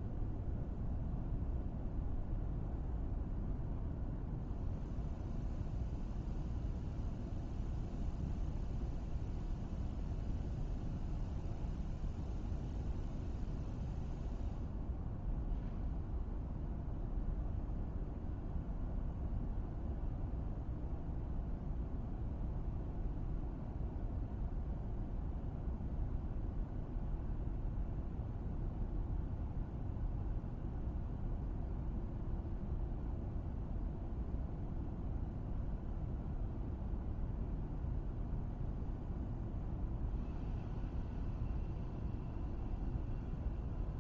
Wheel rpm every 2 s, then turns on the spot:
0, 0, 0, 0, 0, 0, 0, 0, 0, 0, 0, 0, 0, 0, 0, 0, 0, 0, 0, 0, 0, 0.
none